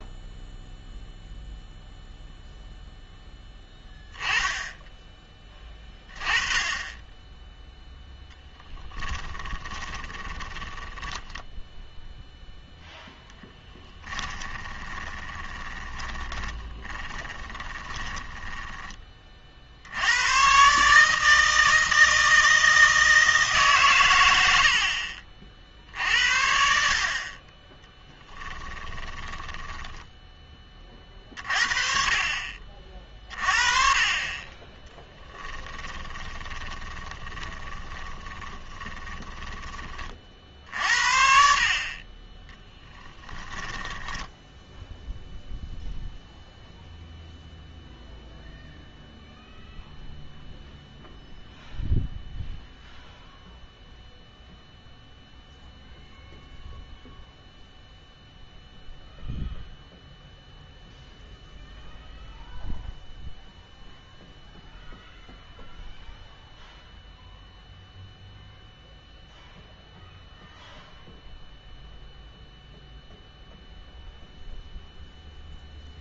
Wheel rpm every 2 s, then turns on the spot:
0, 0, 10, 30, 10, 10, 0, 20, 30, 20, 140, 160, 80, 60, 10, 30, 40, 20, 20, 20, 50, 20, 10, 0, 0, 0, 0, 0, 0, 0, 0, 0, 0, 0, 0, 0, 0, 0.
10-12 14-18 24-26 28-30 36-40 42-46